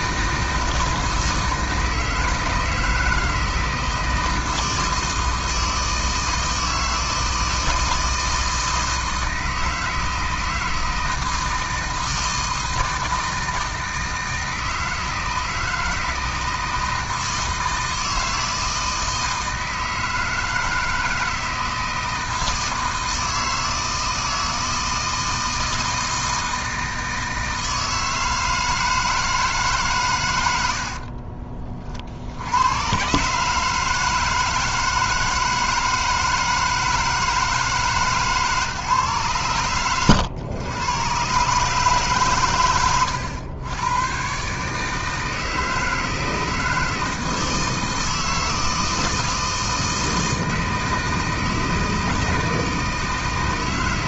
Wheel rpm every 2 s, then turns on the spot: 160, 160, 160, 160, 160, 160, 160, 160, 160, 160, 160, 160, 160, 160, 160, 80, 110, 160, 160, 140, 120, 110, 150, 160, 160, 160, 160.
30-32